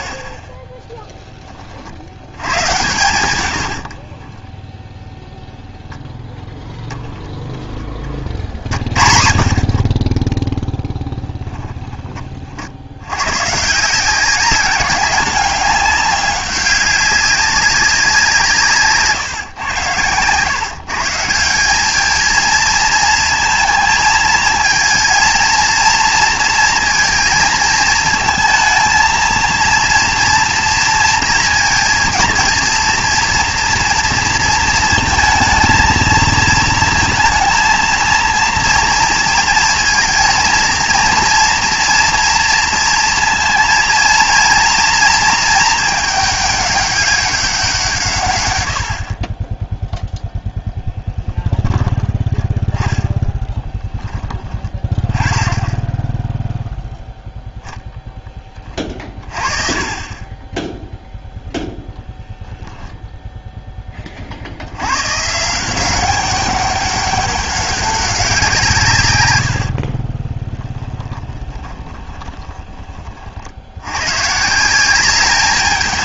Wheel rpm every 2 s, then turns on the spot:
10, 110, 10, 0, 40, 10, 70, 190, 190, 150, 140, 230, 230, 230, 230, 230, 230, 230, 230, 230, 230, 230, 230, 200, 80, 10, 20, 20, 0, 30, 10, 0, 80, 200, 160, 10, 20, 170.
4-6 10-12 70-72